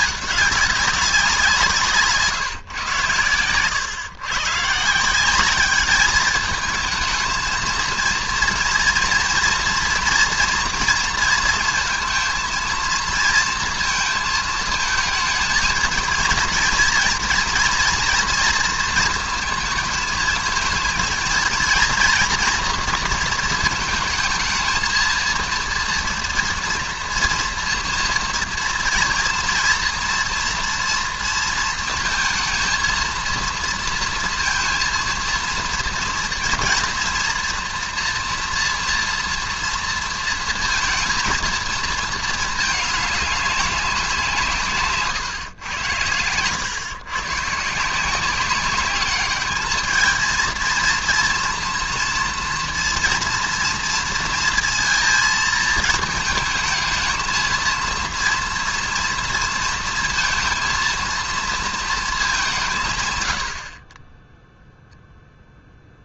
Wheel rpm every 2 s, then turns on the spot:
200, 140, 140, 220, 230, 230, 230, 220, 230, 230, 220, 230, 220, 230, 230, 230, 230, 230, 230, 240, 230, 220, 170, 110, 190, 230, 230, 230, 220, 230, 230, 190, 0.
none